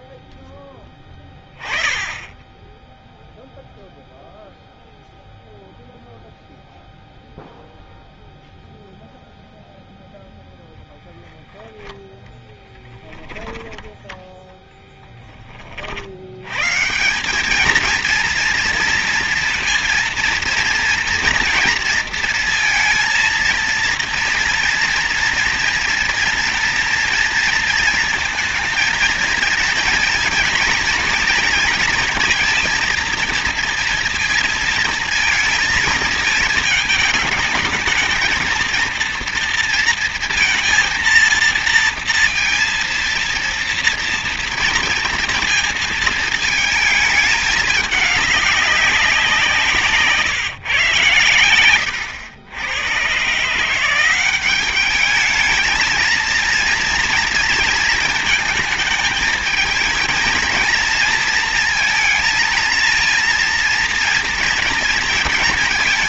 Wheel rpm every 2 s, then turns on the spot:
10, 10, 0, 0, 0, 0, 10, 10, 150, 230, 230, 230, 230, 230, 230, 230, 230, 230, 220, 230, 230, 230, 230, 220, 190, 120, 110, 200, 230, 220, 230, 230, 230.
12-16